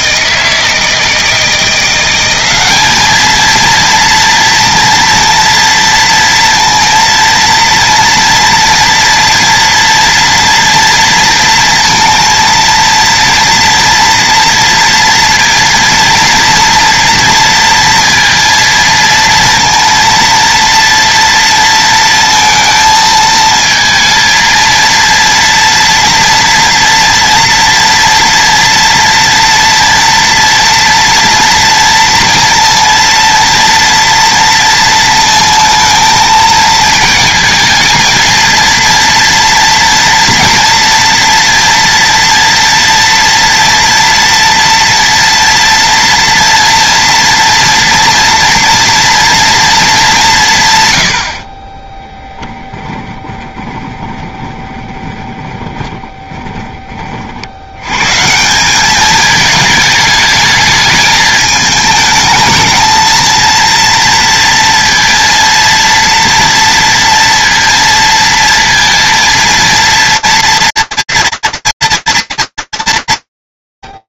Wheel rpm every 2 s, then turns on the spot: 160, 210, 230, 230, 230, 230, 230, 230, 230, 230, 230, 220, 230, 230, 230, 230, 230, 230, 220, 230, 230, 230, 230, 230, 230, 120, 10, 20, 30, 190, 220, 220, 230, 230, 230, 230, 200.
52-56